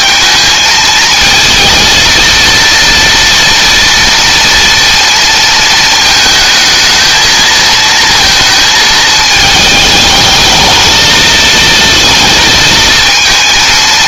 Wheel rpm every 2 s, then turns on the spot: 230, 230, 230, 220, 220, 220, 220.
none